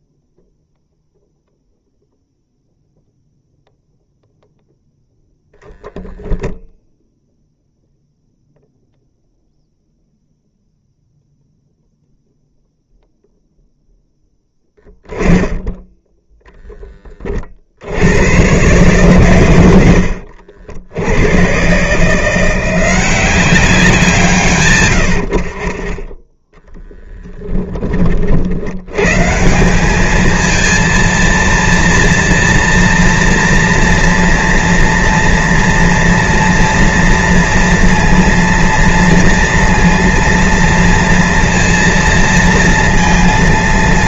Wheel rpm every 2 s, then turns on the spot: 0, 0, 0, 0, 0, 0, 0, 10, 0, 120, 70, 170, 130, 10, 70, 220, 230, 230, 230, 230, 230, 230.
none